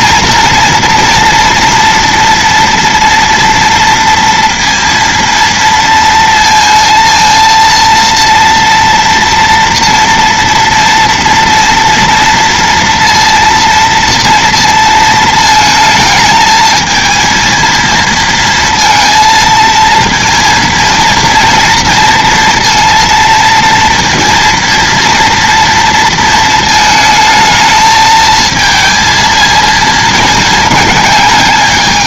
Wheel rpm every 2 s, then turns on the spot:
240, 230, 230, 230, 230, 230, 230, 230, 220, 230, 230, 230, 230, 220, 220, 220.
none